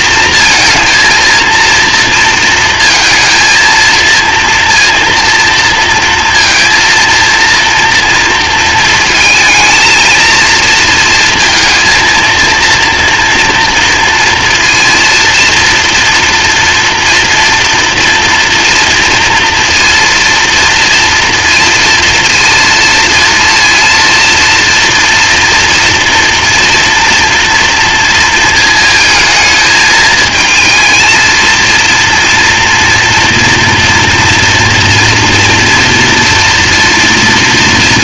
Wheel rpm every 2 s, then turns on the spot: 230, 230, 230, 230, 230, 230, 230, 230, 230, 240, 230, 230, 230, 230, 220, 230, 230, 230, 230.
none